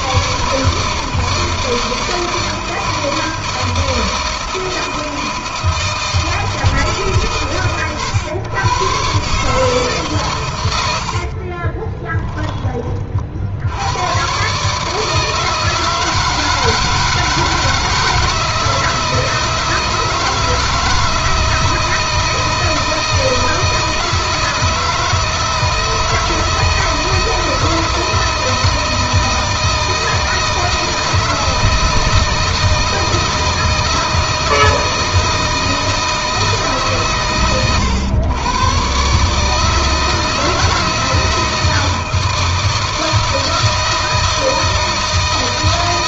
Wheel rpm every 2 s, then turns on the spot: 150, 160, 160, 150, 120, 100, 30, 150, 160, 160, 160, 160, 160, 160, 160, 160, 160, 160, 140, 130, 160, 160, 160.
10-12